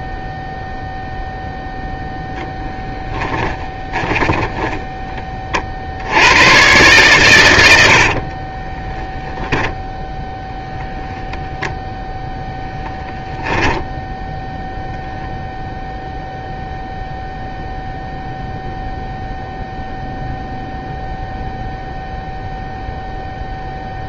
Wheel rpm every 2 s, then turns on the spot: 0, 0, 10, 110, 40, 0, 0, 0, 0, 0, 0, 0.
8-10